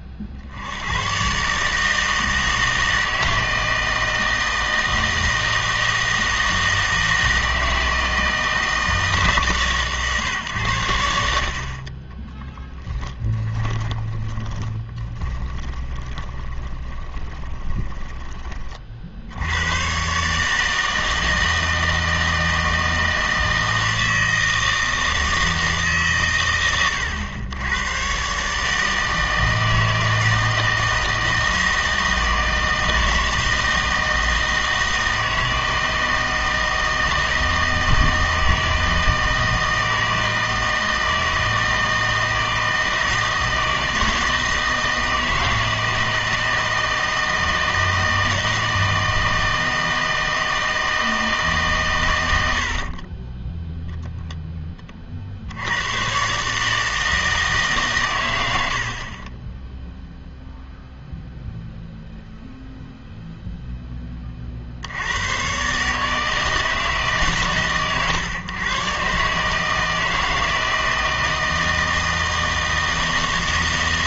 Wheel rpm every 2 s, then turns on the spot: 50, 160, 160, 160, 160, 120, 20, 30, 20, 30, 150, 160, 160, 110, 150, 160, 160, 160, 160, 160, 160, 160, 160, 160, 160, 160, 70, 10, 150, 80, 0, 0, 50, 160, 120, 160, 160.
12-18